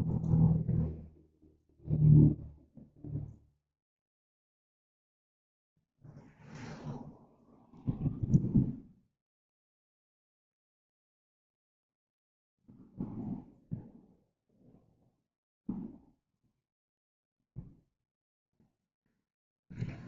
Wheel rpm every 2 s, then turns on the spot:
0, 0, 0, 0, 0, 0, 0, 0, 0, 0.
none